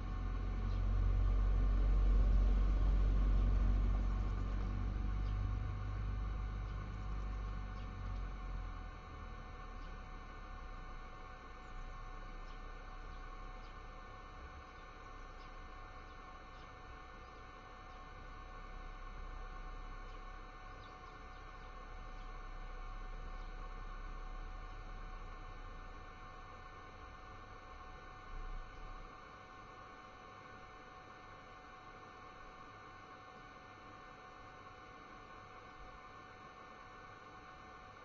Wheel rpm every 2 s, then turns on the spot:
0, 0, 0, 0, 0, 0, 0, 0, 0, 0, 0, 0, 0, 0, 0, 0, 0, 0, 0.
none